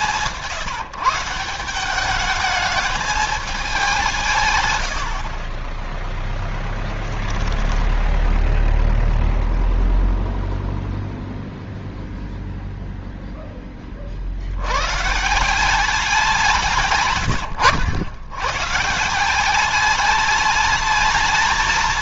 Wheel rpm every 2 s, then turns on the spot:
160, 210, 130, 10, 0, 0, 0, 70, 160, 130, 210.
4-6